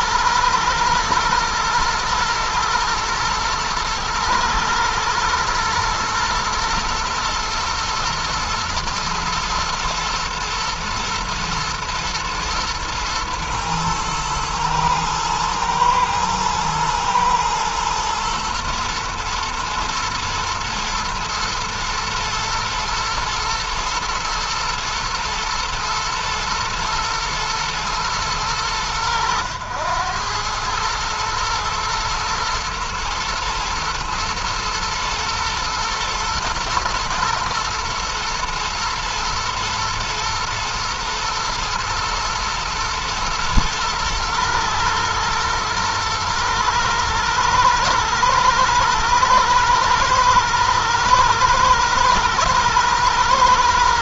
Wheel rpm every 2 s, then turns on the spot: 120, 110, 120, 120, 110, 120, 110, 110, 120, 110, 120, 110, 120, 110, 90, 110, 110, 110, 120, 120, 120, 120, 110, 110, 110, 110, 110.
none